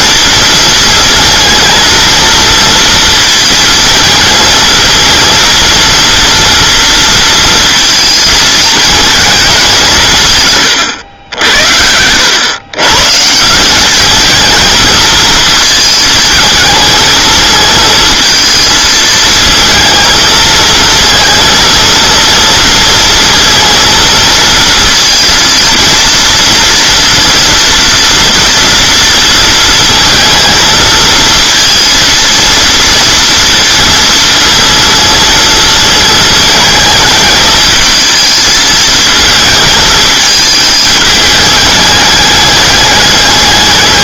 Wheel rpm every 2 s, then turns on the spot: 230, 230, 230, 230, 220, 120, 130, 220, 220, 220, 220, 230, 230, 240, 230, 220, 230, 230, 210, 220, 220, 200.
none